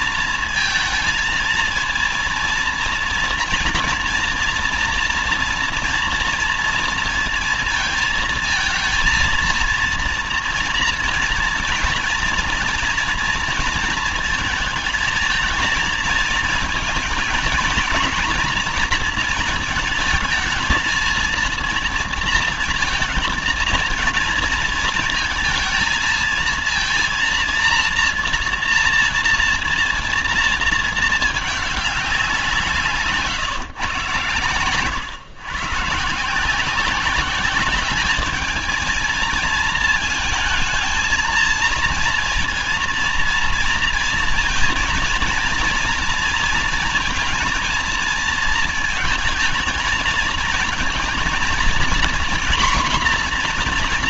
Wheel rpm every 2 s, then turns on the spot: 230, 230, 230, 230, 230, 230, 230, 220, 220, 230, 220, 230, 230, 220, 230, 220, 170, 130, 160, 220, 220, 230, 230, 230, 220, 230, 240.
none